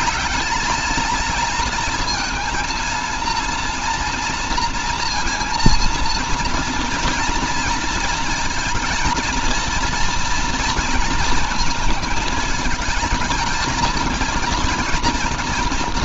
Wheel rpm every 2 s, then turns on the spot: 220, 230, 230, 230, 230, 230, 220, 230.
none